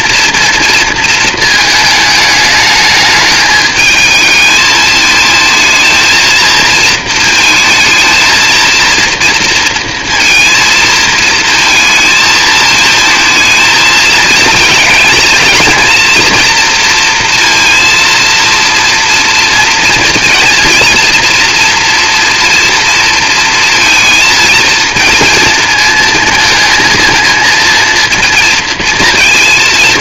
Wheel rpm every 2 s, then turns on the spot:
230, 210, 220, 220, 230, 230, 230, 220, 230, 230, 230, 230, 230, 230, 220.
none